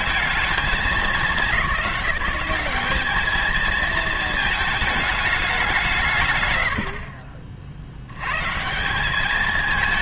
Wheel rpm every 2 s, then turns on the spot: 210, 200, 220, 100, 170.
none